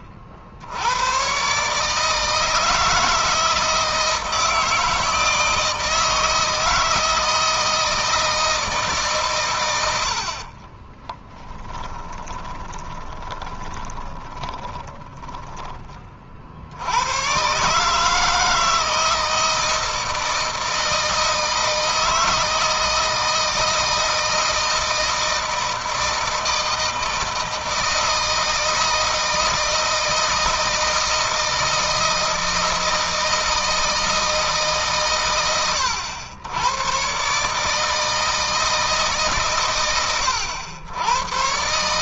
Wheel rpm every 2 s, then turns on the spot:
80, 160, 160, 160, 160, 40, 10, 10, 70, 160, 160, 160, 160, 160, 160, 160, 160, 150, 100, 160, 90.
10-16